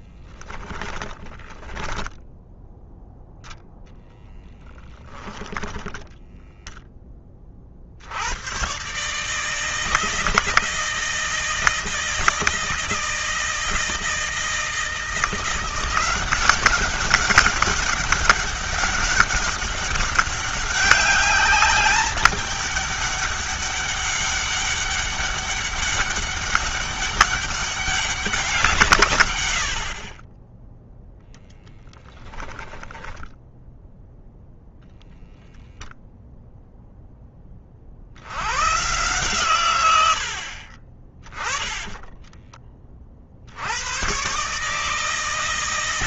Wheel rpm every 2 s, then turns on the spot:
20, 0, 10, 10, 130, 160, 160, 160, 190, 200, 200, 210, 200, 200, 150, 0, 10, 0, 0, 130, 40, 40, 150.
0-2 4-6 32-34